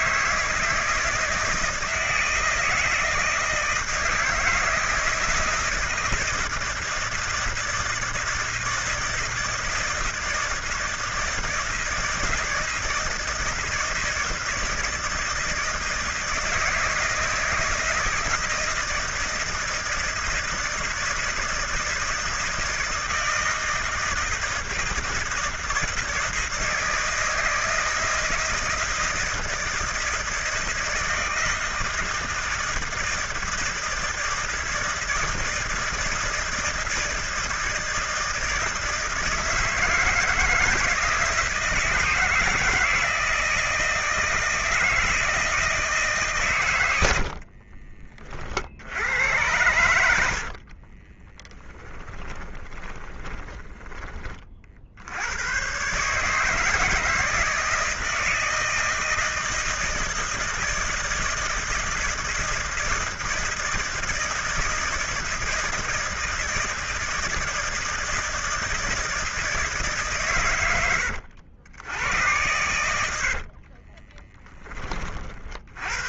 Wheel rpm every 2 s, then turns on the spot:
160, 160, 160, 160, 160, 160, 170, 170, 160, 160, 160, 160, 160, 160, 160, 160, 160, 160, 160, 160, 160, 160, 160, 110, 60, 40, 20, 50, 160, 160, 160, 160, 160, 160, 160, 110, 90, 20.
50-54 72-74